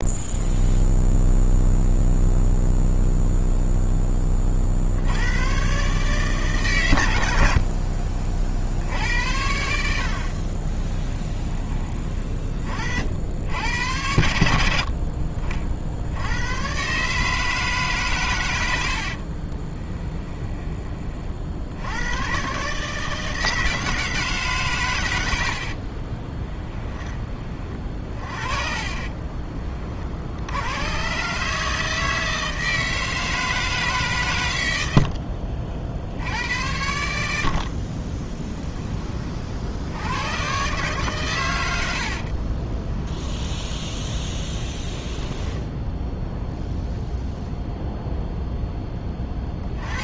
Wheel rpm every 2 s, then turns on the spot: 0, 0, 60, 120, 70, 20, 60, 60, 140, 50, 30, 150, 110, 20, 40, 120, 160, 80, 80, 20, 130, 20, 10, 0, 10.
10-12 14-16 18-20 28-30 42-46